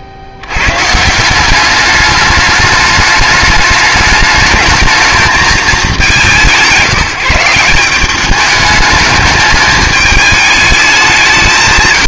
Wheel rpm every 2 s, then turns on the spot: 60, 210, 220, 150, 200, 210.
none